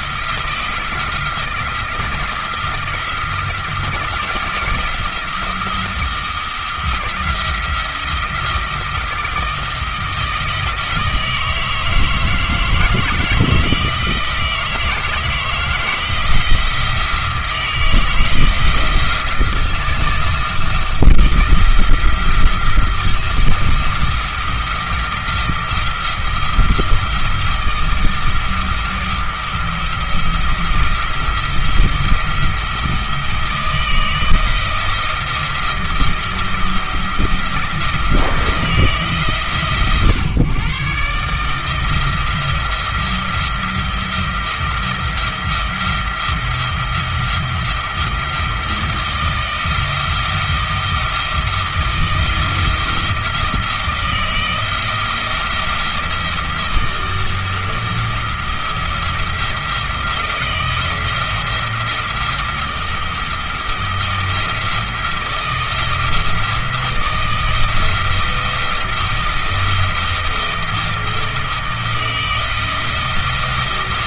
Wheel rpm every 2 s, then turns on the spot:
160, 170, 170, 170, 170, 160, 160, 170, 160, 160, 170, 170, 170, 170, 170, 170, 160, 170, 170, 160, 130, 170, 170, 170, 170, 170, 170, 160, 170, 170, 170, 170, 170, 170, 160, 160, 160.
none